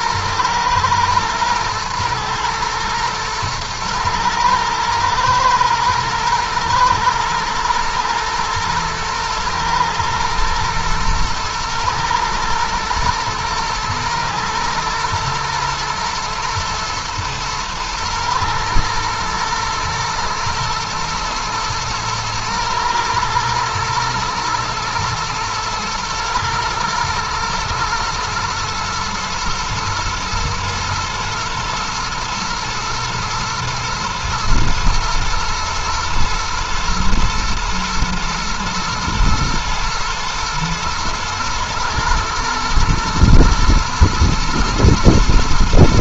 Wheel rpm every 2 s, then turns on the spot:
120, 120, 120, 110, 110, 110, 110, 110, 110, 110, 110, 120, 120, 110, 110, 110, 120, 120, 120, 110, 120, 110, 110.
none